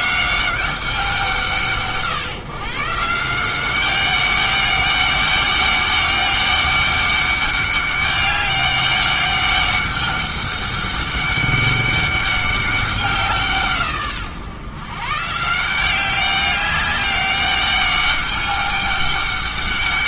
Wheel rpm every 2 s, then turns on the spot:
190, 150, 200, 200, 200, 200, 190, 130, 200, 200.
none